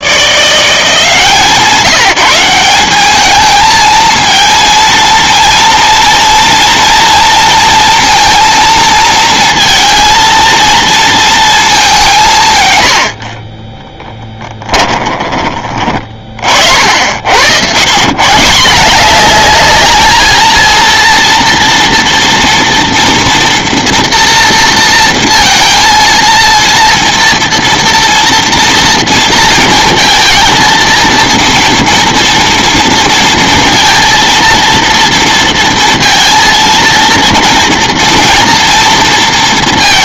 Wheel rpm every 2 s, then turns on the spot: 170, 190, 230, 230, 230, 230, 110, 20, 60, 180, 230, 230, 230, 230, 230, 230, 230, 230, 230, 230.
14-16